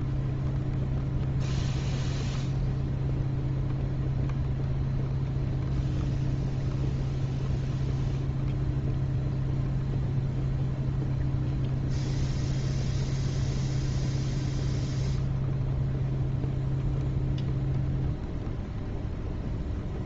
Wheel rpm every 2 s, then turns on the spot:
0, 0, 0, 0, 0, 0, 0, 0, 0, 0.
none